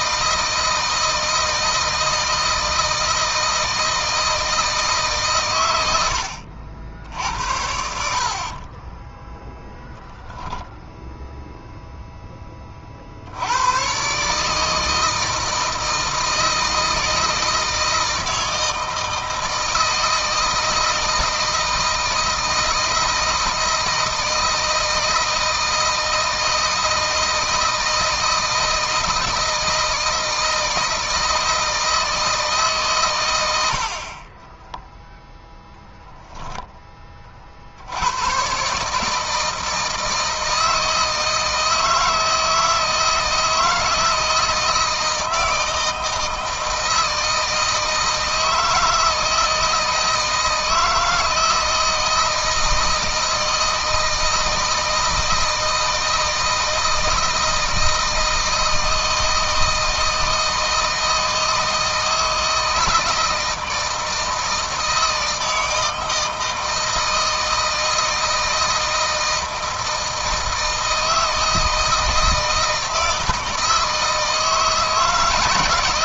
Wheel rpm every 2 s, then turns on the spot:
160, 160, 160, 70, 40, 10, 30, 150, 160, 160, 160, 160, 160, 160, 160, 160, 140, 20, 10, 140, 160, 160, 160, 160, 160, 160, 160, 160, 160, 160, 160, 160, 160, 160, 170, 160, 160, 160.
8-10 34-36